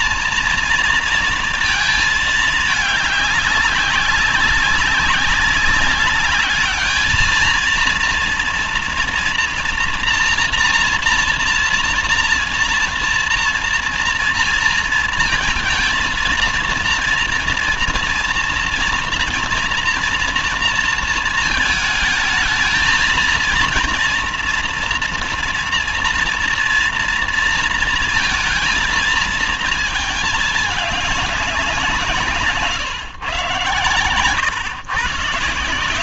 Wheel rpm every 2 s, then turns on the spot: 230, 210, 200, 210, 230, 230, 230, 230, 230, 230, 230, 220, 230, 230, 230, 210, 130, 120.
none